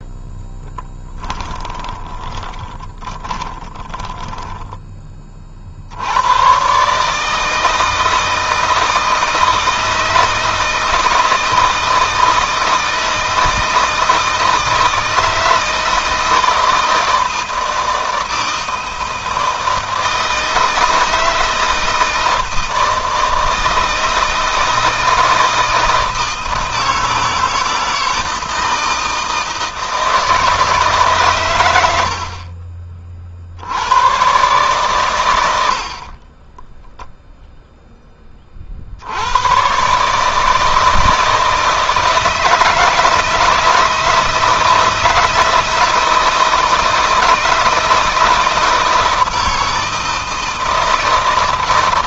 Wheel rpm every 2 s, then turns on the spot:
10, 30, 20, 140, 160, 160, 160, 160, 160, 160, 160, 160, 160, 160, 160, 150, 40, 120, 10, 70, 160, 160, 160, 160, 160, 160.
0-4